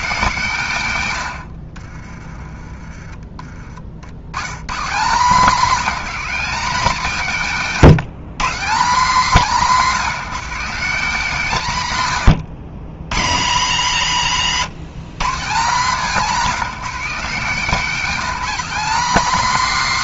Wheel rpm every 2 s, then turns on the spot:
140, 20, 140, 210, 200, 200, 90, 150, 190, 210.
none